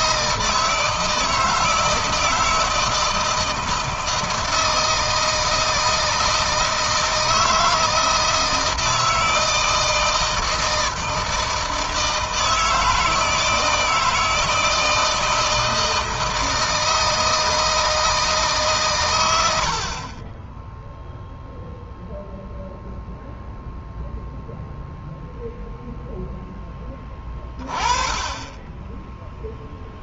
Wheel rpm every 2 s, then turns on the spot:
160, 160, 160, 160, 160, 160, 160, 160, 160, 140, 10, 0, 0, 10, 10.
none